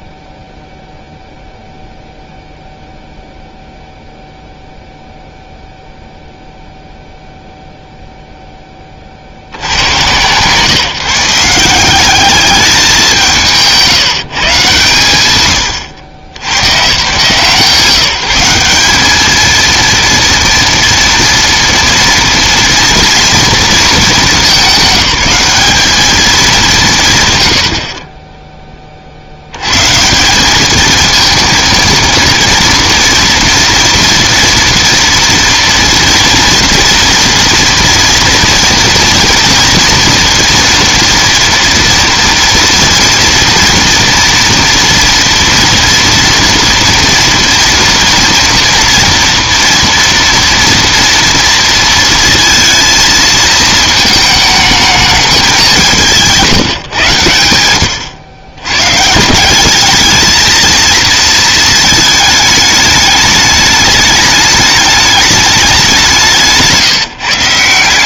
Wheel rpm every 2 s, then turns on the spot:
0, 0, 0, 0, 20, 140, 190, 130, 110, 200, 230, 230, 210, 200, 20, 220, 230, 230, 230, 240, 230, 230, 230, 230, 230, 230, 230, 210, 160, 160, 230, 210, 210, 170.
none